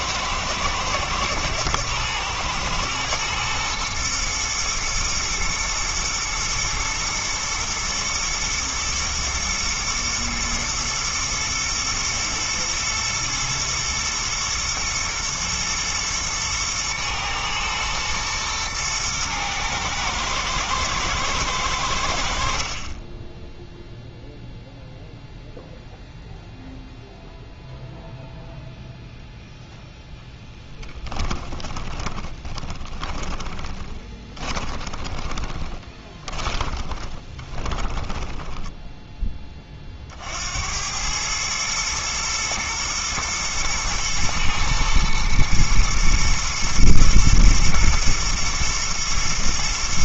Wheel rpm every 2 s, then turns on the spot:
110, 110, 110, 120, 110, 110, 110, 110, 110, 110, 110, 30, 0, 0, 0, 20, 20, 20, 20, 10, 100, 110, 120, 120, 110.
30-38